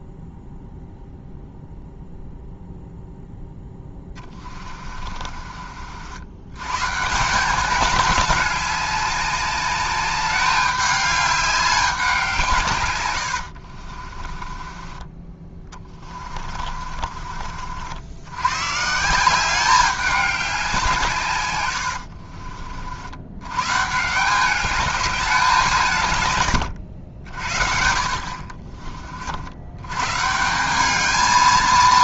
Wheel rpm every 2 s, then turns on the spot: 0, 0, 30, 140, 200, 200, 120, 20, 40, 140, 170, 70, 200, 80, 50, 200.
4-6 16-18 26-28